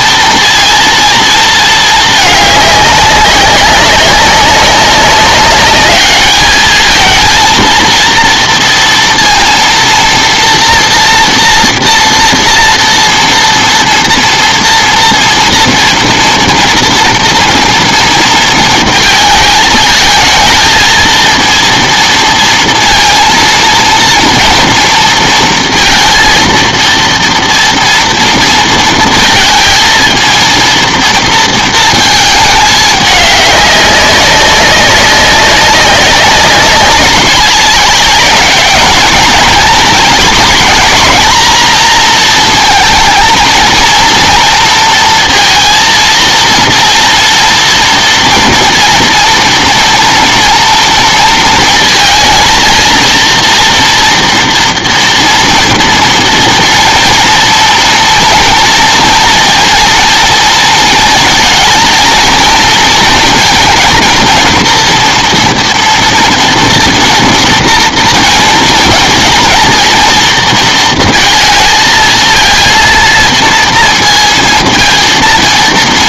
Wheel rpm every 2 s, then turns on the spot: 230, 200, 200, 220, 230, 230, 230, 230, 230, 220, 220, 230, 230, 230, 230, 230, 210, 190, 190, 220, 230, 220, 230, 230, 230, 230, 230, 230, 230, 230, 230, 230, 240, 230, 230, 230, 230, 230.
none